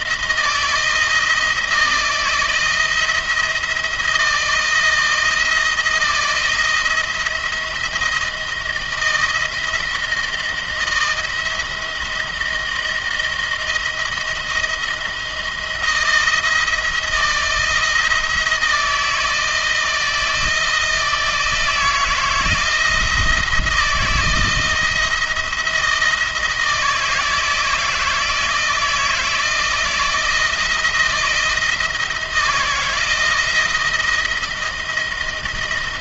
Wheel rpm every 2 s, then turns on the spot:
160, 160, 170, 170, 160, 170, 170, 160, 160, 160, 160, 160, 170, 160, 160, 160, 160, 160.
none